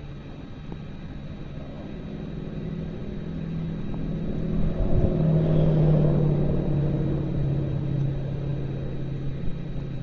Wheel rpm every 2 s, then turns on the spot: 0, 0, 0, 0, 0.
none